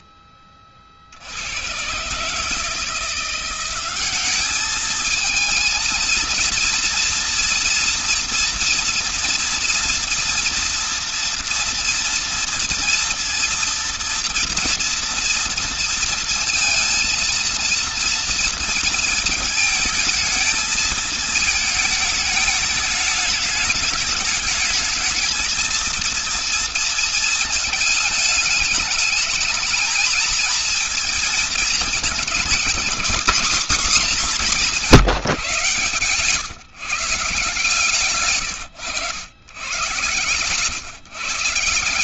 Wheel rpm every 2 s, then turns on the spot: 10, 150, 200, 230, 230, 230, 230, 240, 230, 230, 220, 210, 210, 230, 220, 220, 220, 220, 140, 140, 130.
none